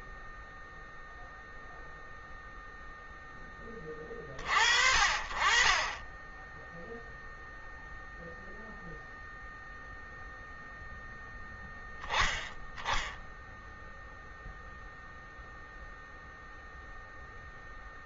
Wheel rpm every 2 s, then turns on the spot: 0, 0, 40, 0, 0, 0, 0, 0, 0.
none